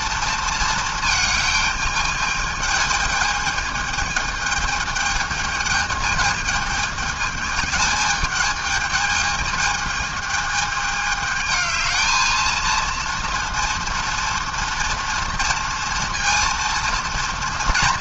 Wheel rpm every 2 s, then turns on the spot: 230, 210, 210, 220, 210, 210, 230, 230, 230.
none